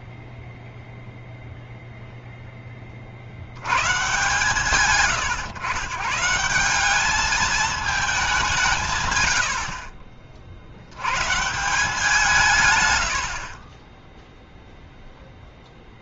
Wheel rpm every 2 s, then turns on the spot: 0, 10, 140, 190, 170, 60, 140, 0.
none